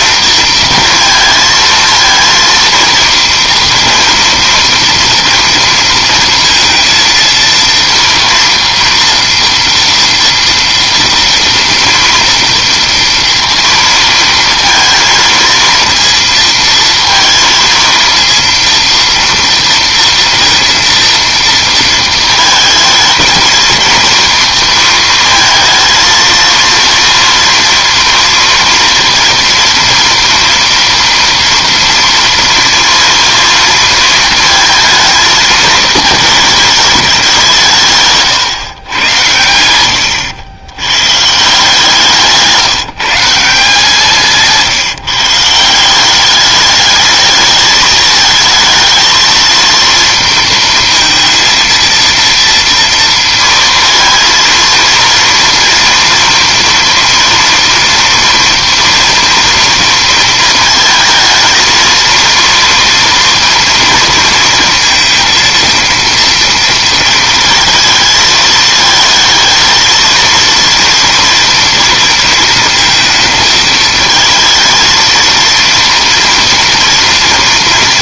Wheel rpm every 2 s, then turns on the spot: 230, 230, 230, 230, 230, 240, 230, 230, 230, 230, 230, 220, 230, 230, 230, 230, 230, 230, 220, 130, 100, 170, 160, 210, 220, 230, 230, 230, 230, 230, 220, 230, 230, 230, 220, 230, 230, 220, 230.
none